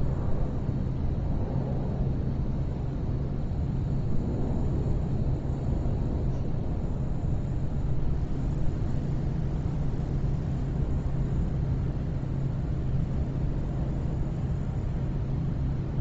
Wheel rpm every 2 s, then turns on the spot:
0, 0, 0, 0, 0, 0, 0, 0.
none